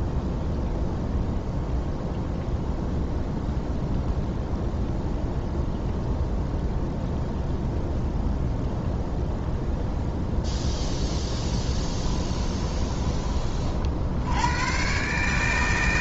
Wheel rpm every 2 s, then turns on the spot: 0, 0, 0, 0, 0, 0, 20, 120.
none